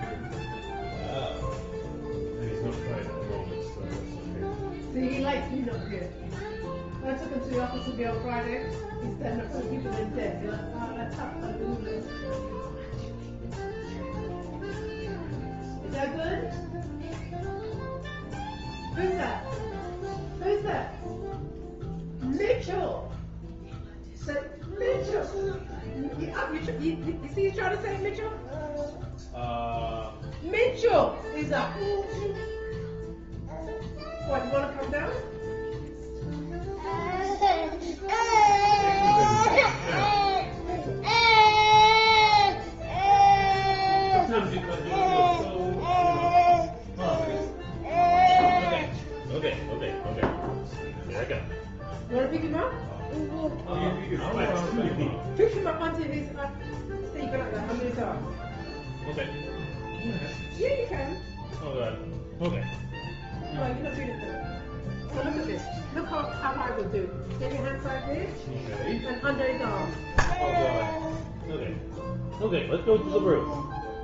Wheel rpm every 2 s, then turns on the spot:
0, 0, 0, 0, 0, 0, 0, 0, 0, 0, 0, 0, 0, 0, 0, 0, 0, 0, 0, 0, 0, 0, 0, 0, 0, 0, 0, 0, 0, 0, 0, 0, 0, 0, 0, 0, 0.
none